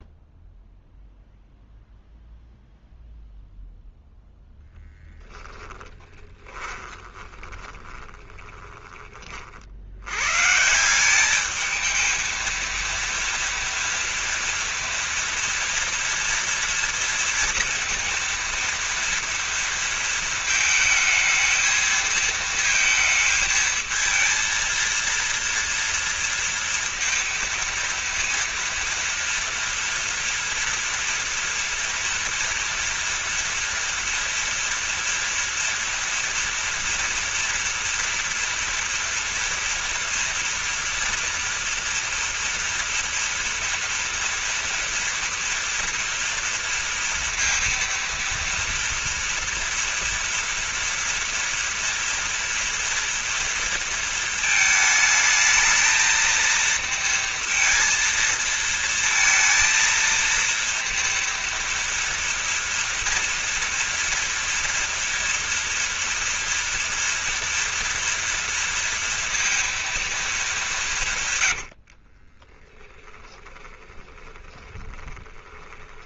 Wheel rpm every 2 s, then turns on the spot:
0, 0, 0, 20, 20, 170, 230, 230, 230, 230, 220, 230, 230, 230, 230, 230, 230, 230, 230, 230, 240, 230, 230, 230, 230, 230, 240, 220, 230, 230, 230, 230, 230, 230, 230, 200, 20, 20.
6-10 72-76